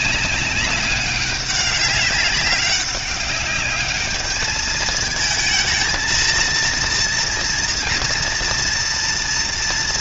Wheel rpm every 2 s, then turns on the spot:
200, 200, 220, 230, 240.
none